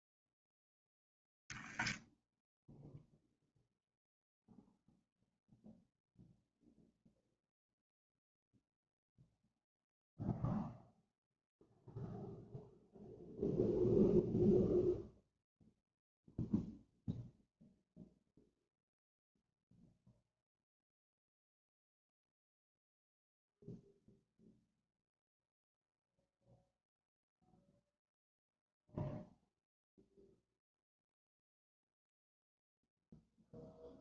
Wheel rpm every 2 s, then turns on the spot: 20, 0, 0, 0, 0, 0, 0, 0, 0, 0, 0, 0, 0, 0, 0, 0, 0.
none